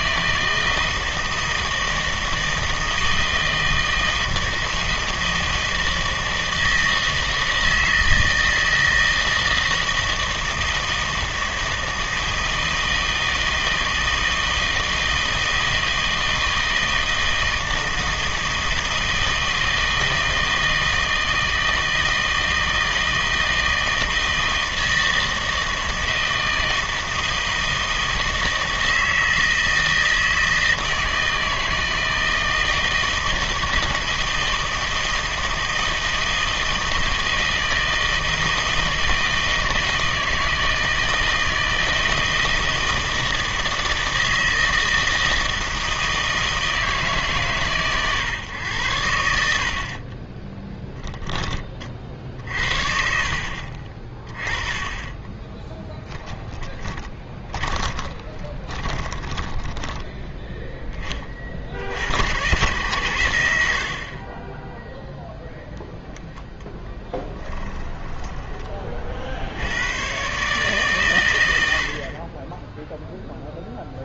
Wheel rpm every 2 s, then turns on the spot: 160, 160, 160, 160, 160, 160, 160, 160, 160, 160, 160, 160, 160, 160, 160, 160, 160, 160, 160, 160, 160, 160, 160, 150, 100, 10, 60, 20, 20, 20, 10, 110, 10, 0, 30, 140, 10.
50-52 56-60